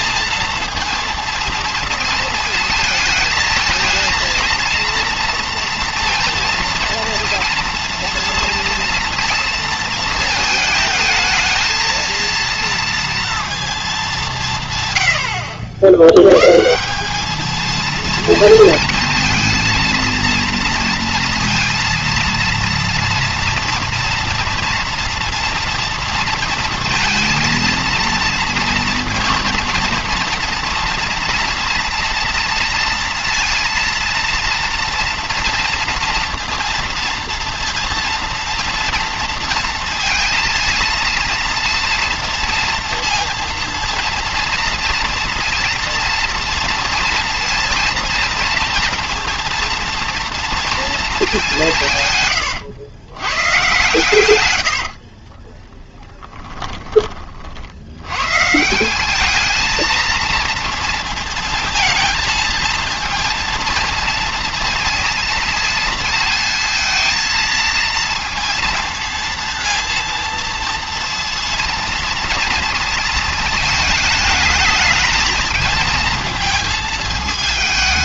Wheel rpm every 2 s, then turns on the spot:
230, 220, 230, 230, 230, 220, 230, 170, 140, 230, 230, 230, 230, 230, 230, 230, 230, 230, 230, 230, 230, 240, 230, 230, 230, 230, 110, 80, 10, 160, 230, 220, 230, 230, 230, 230, 230, 220, 220.
54-58